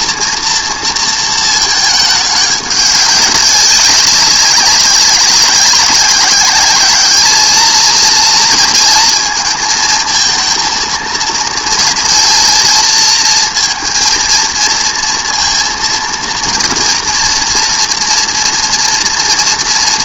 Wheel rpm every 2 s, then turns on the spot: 230, 200, 200, 210, 230, 230, 230, 230, 230, 230.
none